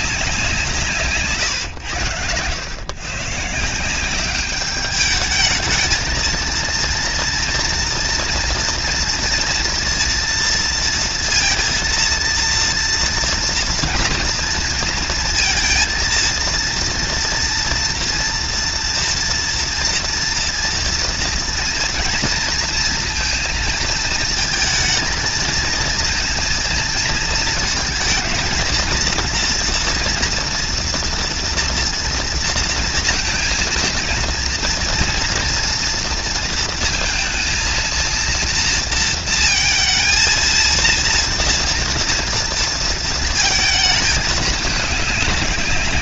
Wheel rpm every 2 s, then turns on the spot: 140, 140, 210, 230, 230, 230, 230, 230, 230, 240, 240, 230, 230, 220, 230, 230, 230, 230, 230, 230, 230, 230, 200.
none